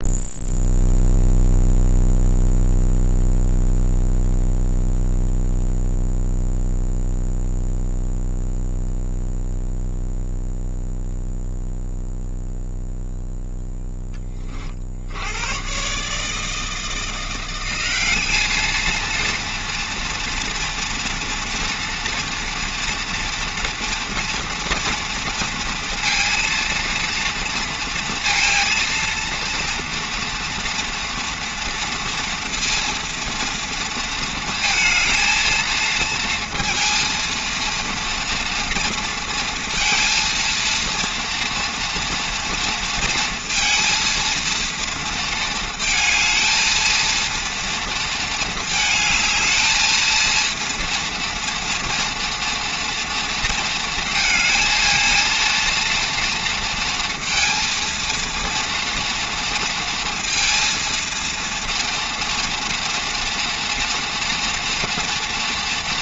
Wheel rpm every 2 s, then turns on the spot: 0, 0, 0, 0, 0, 0, 0, 50, 170, 230, 230, 230, 230, 230, 230, 230, 230, 230, 230, 240, 230, 230, 230, 230, 220, 230, 230, 220, 230, 230, 230, 230, 230.
none